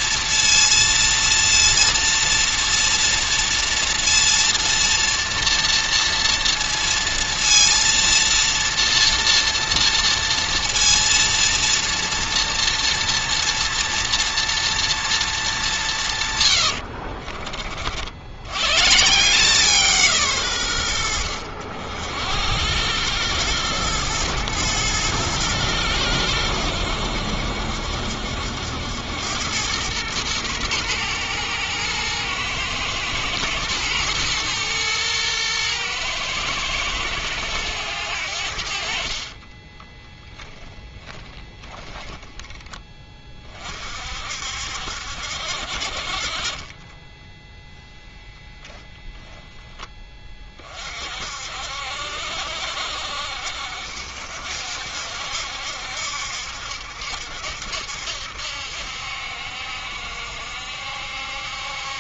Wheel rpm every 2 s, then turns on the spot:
230, 230, 230, 230, 230, 230, 230, 230, 80, 120, 100, 90, 110, 90, 80, 110, 110, 120, 110, 60, 10, 10, 70, 20, 0, 40, 60, 70, 70, 70, 70.
16-18 46-48